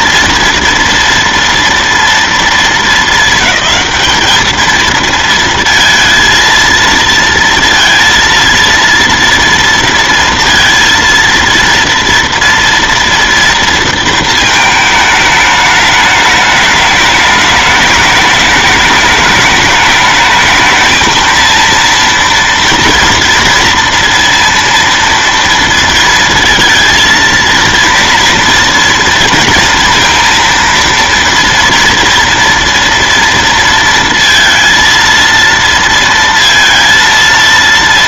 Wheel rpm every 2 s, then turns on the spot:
230, 230, 220, 230, 230, 230, 230, 220, 210, 210, 220, 230, 230, 230, 230, 230, 230, 230, 230.
none